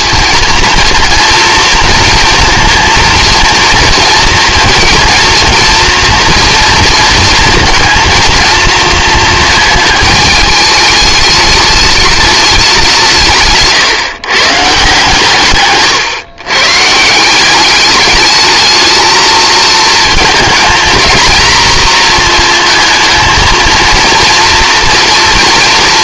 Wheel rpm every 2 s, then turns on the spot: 230, 240, 230, 230, 230, 210, 180, 140, 150, 220, 230, 230, 230.
none